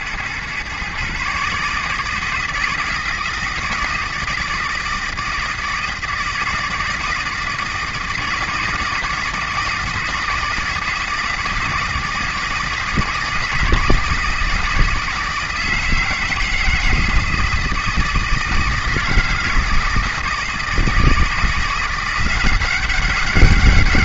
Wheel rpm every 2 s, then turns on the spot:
140, 160, 160, 160, 160, 160, 160, 160, 160, 160, 160, 190.
none